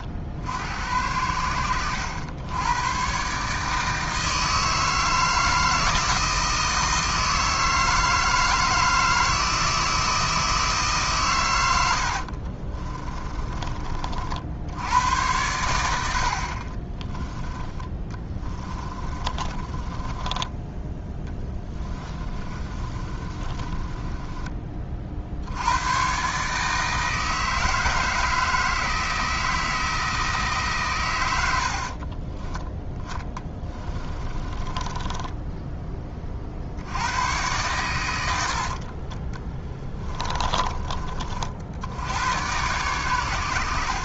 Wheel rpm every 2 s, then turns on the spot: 80, 110, 160, 160, 160, 150, 40, 80, 30, 20, 10, 30, 40, 150, 160, 130, 20, 20, 80, 40, 30, 80.
12-14 18-20 22-24 32-36 38-40